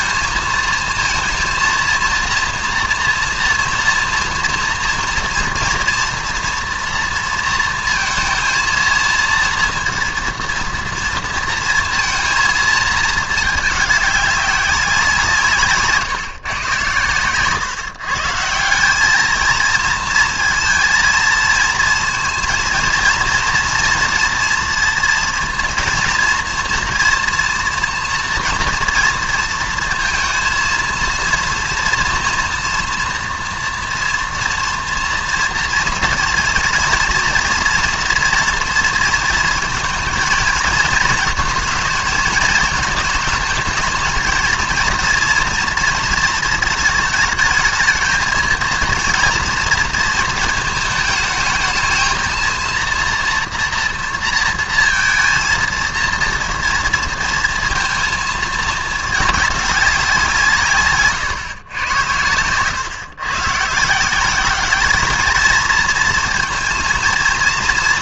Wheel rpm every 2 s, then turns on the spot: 230, 230, 230, 230, 230, 230, 230, 200, 140, 150, 230, 230, 230, 230, 230, 230, 240, 230, 230, 230, 230, 220, 220, 230, 220, 220, 230, 240, 230, 230, 180, 110, 170, 230.
none